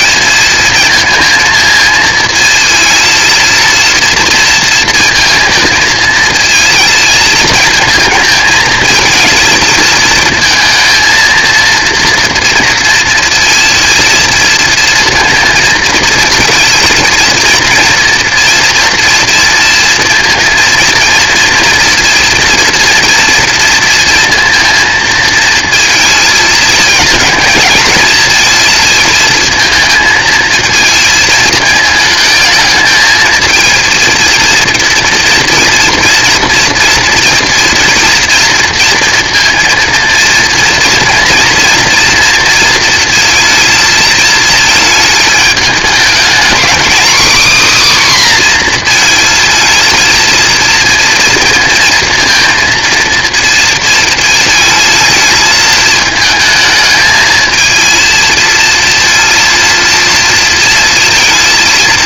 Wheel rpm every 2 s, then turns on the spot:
220, 230, 230, 220, 220, 230, 240, 230, 220, 230, 230, 230, 230, 220, 230, 220, 220, 230, 230, 230, 230, 230, 220, 250, 250, 230, 230, 220, 220, 230, 230.
none